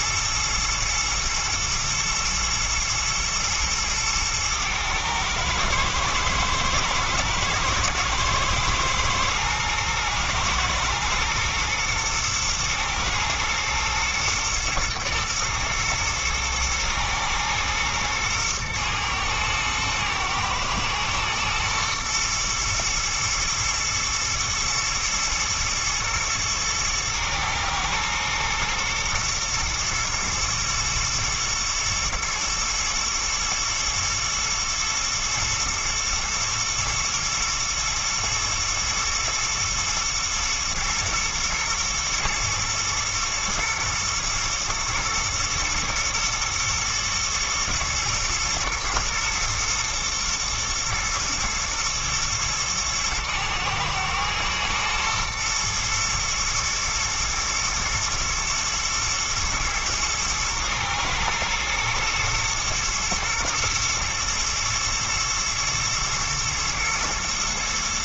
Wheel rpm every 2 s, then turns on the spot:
110, 120, 110, 110, 120, 120, 120, 120, 110, 110, 110, 110, 110, 110, 110, 110, 110, 120, 120, 110, 110, 120, 110, 120, 110, 110, 110, 110, 110, 120, 110, 110, 110, 120.
none